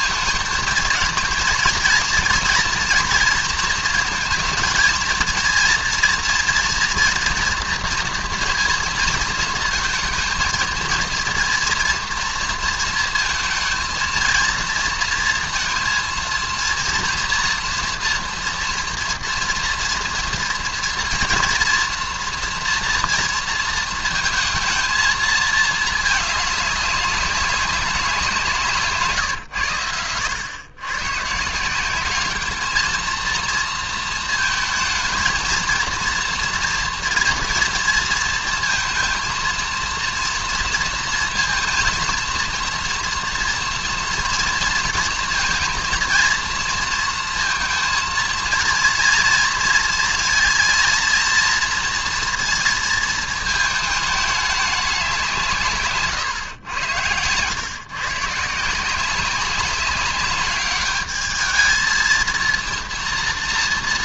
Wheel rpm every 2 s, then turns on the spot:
220, 230, 220, 230, 230, 230, 230, 230, 230, 230, 230, 230, 230, 200, 170, 100, 210, 220, 230, 230, 230, 230, 230, 230, 230, 230, 230, 210, 120, 160, 200, 230.
none